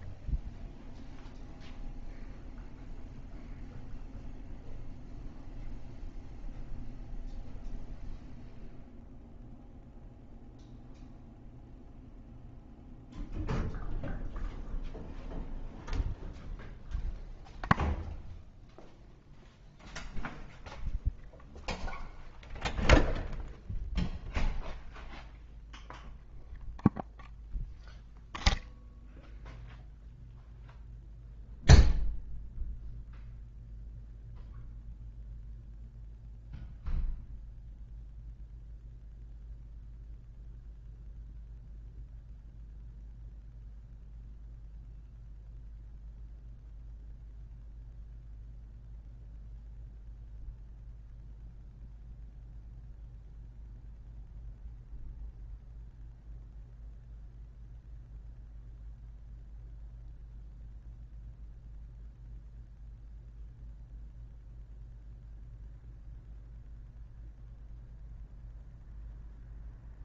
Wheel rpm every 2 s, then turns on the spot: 0, 0, 0, 0, 0, 0, 0, 0, 0, 0, 0, 0, 0, 0, 0, 0, 0, 0, 0, 0, 0, 0, 0, 0, 0, 0, 0, 0, 0, 0, 0, 0, 0, 0, 0.
none